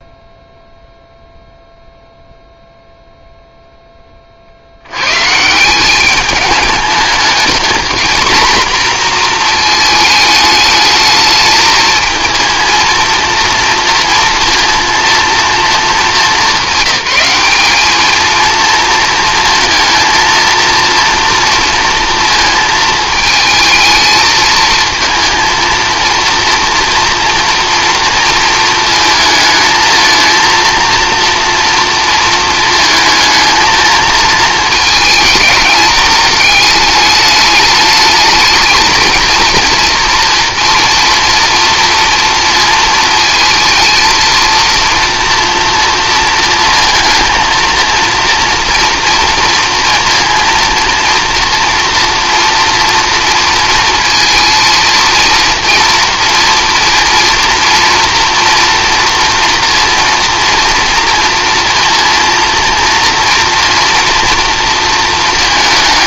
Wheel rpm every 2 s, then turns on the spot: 0, 0, 70, 210, 240, 220, 230, 230, 200, 230, 230, 220, 230, 230, 230, 230, 220, 220, 210, 220, 230, 230, 230, 230, 230, 230, 230, 230, 240, 230, 230, 230, 230.
none